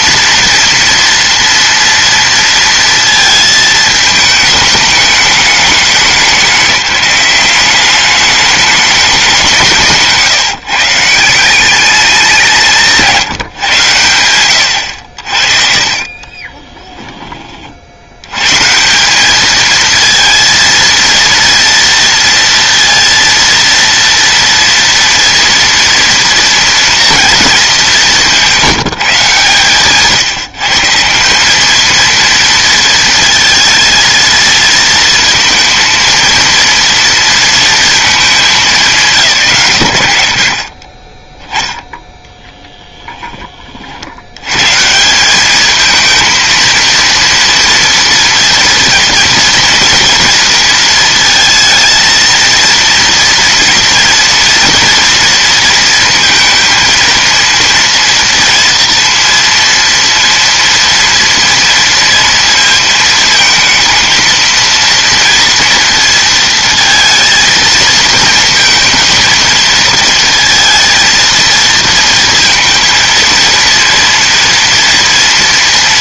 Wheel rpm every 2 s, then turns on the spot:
230, 230, 220, 200, 210, 150, 170, 90, 20, 160, 230, 230, 230, 230, 160, 140, 230, 220, 230, 190, 60, 10, 130, 230, 230, 230, 230, 230, 230, 230, 230, 230, 230, 230, 220, 220, 230, 230.
16-18